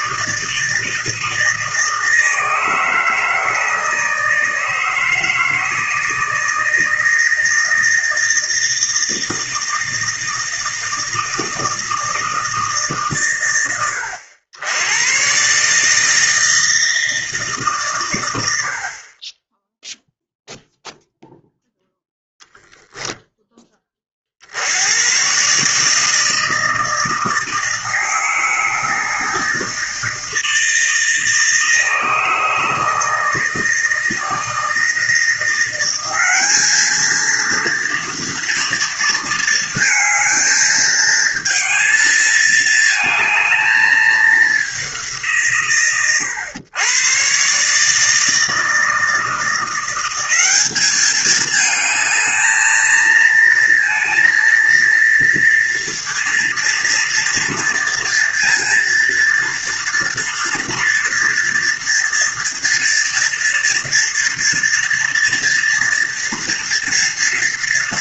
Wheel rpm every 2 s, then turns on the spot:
160, 160, 160, 160, 160, 160, 150, 90, 160, 60, 0, 0, 90, 160, 160, 160, 160, 160, 210, 230, 220, 220, 220, 120, 160, 200, 220, 230, 230, 230, 230, 240, 230, 230.
none